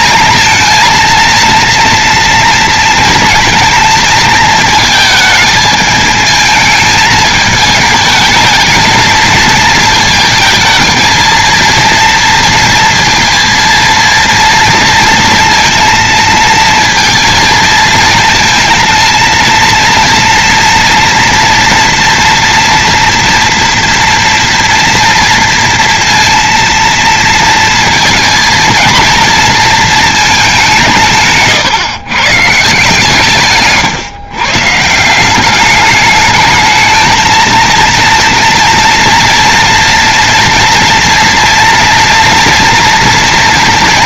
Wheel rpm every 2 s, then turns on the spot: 230, 230, 220, 220, 220, 220, 230, 230, 230, 230, 230, 230, 230, 230, 230, 200, 140, 140, 210, 230, 240, 230.
none